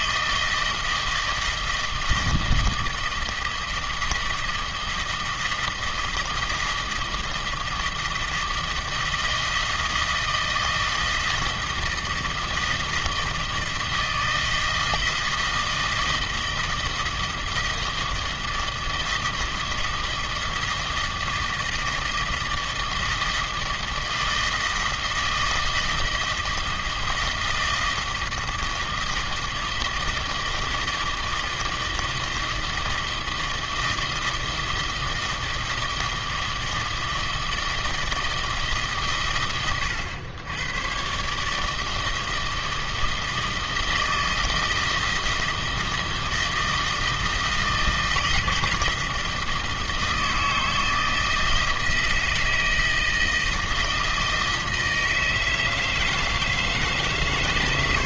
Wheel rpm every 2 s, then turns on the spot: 160, 160, 160, 160, 160, 160, 160, 160, 160, 160, 160, 160, 160, 160, 160, 160, 160, 160, 160, 150, 120, 160, 160, 160, 170, 160, 160, 160, 150.
none